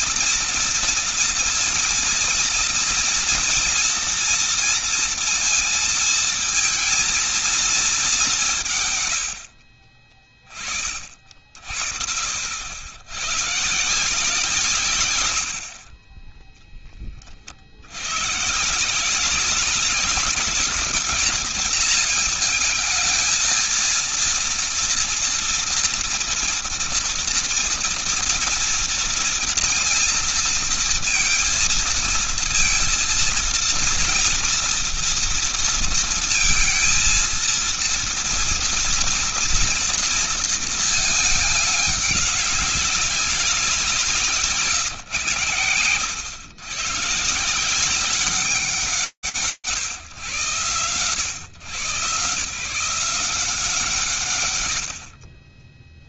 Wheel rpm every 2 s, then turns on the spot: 230, 240, 230, 220, 180, 30, 70, 160, 20, 130, 200, 220, 230, 230, 230, 230, 230, 230, 220, 230, 230, 200, 150, 110, 160, 120, 160, 80.
none